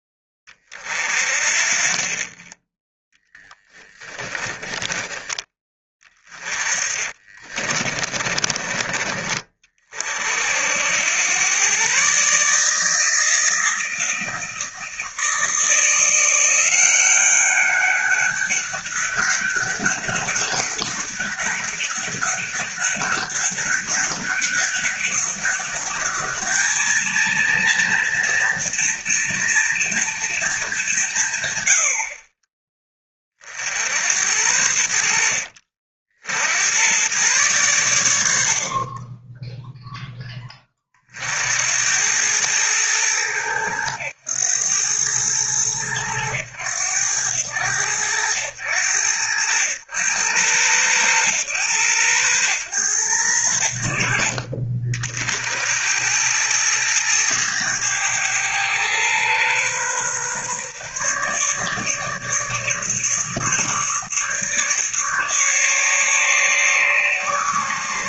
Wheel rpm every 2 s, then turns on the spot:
40, 10, 10, 30, 30, 80, 160, 160, 180, 200, 200, 200, 200, 220, 230, 190, 20, 80, 100, 50, 30, 110, 110, 100, 90, 100, 110, 50, 110, 110, 140, 150, 150, 150.
4-8